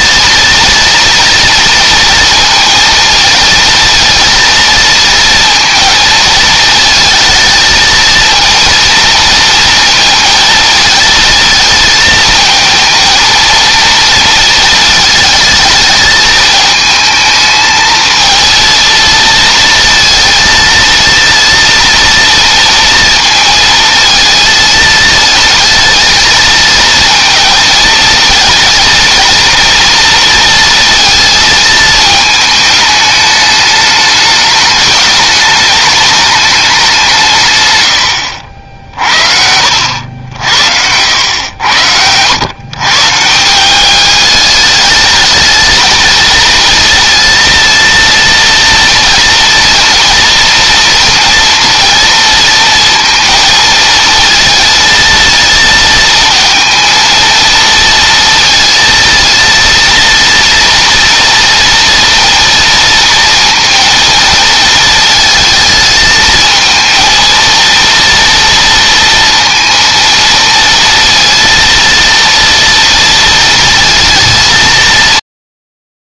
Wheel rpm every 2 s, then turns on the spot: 240, 230, 230, 220, 230, 220, 230, 220, 220, 230, 230, 230, 220, 230, 230, 230, 210, 210, 190, 60, 80, 140, 210, 230, 230, 230, 230, 220, 230, 230, 230, 230, 220, 220, 230, 230, 230, 190.
none